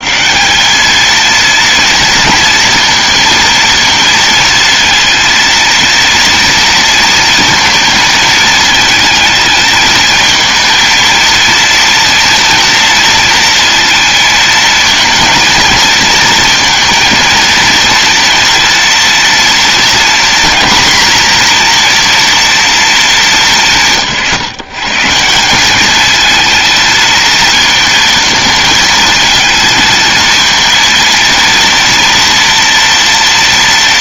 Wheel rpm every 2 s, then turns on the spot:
150, 230, 230, 230, 220, 220, 230, 220, 230, 230, 240, 240, 160, 220, 220, 220, 230.
none